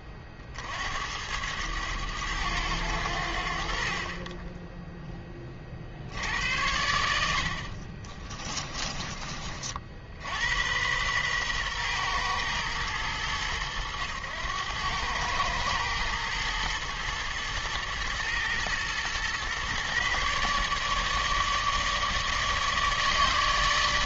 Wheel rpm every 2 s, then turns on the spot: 80, 80, 0, 80, 30, 110, 100, 100, 110, 120, 150, 150.
8-10